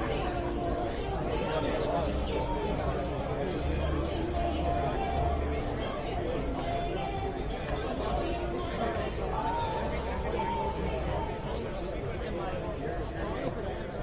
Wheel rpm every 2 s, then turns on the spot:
0, 0, 0, 0, 0, 0, 0.
none